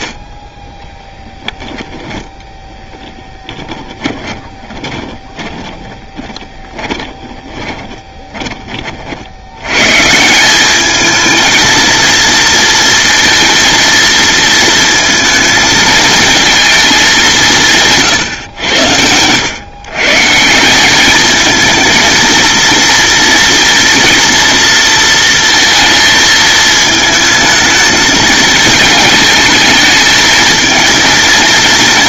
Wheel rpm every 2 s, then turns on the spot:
20, 10, 20, 30, 40, 210, 230, 220, 210, 90, 200, 230, 230, 220, 220, 230.
0-8